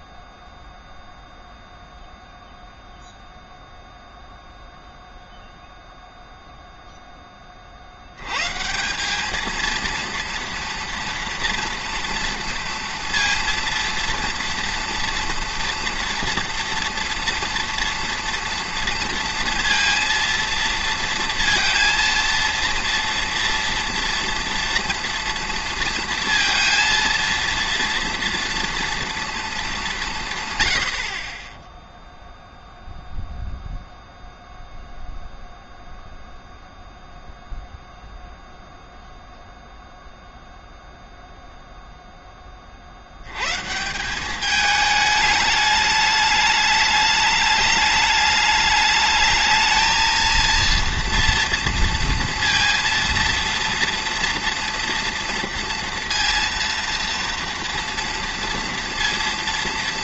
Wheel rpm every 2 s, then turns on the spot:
0, 0, 0, 0, 140, 230, 230, 230, 230, 230, 230, 230, 230, 230, 230, 120, 0, 0, 0, 0, 0, 30, 210, 210, 210, 230, 230, 230, 230, 230.
none